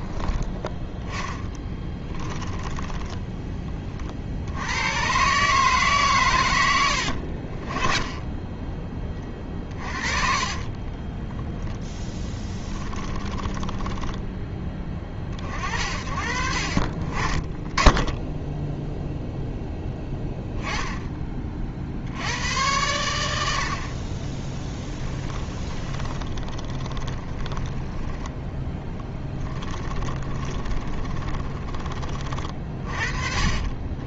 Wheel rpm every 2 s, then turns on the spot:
10, 10, 100, 80, 20, 20, 20, 20, 50, 0, 10, 90, 10, 20, 10, 20, 40.
2-4 10-14 24-28 30-32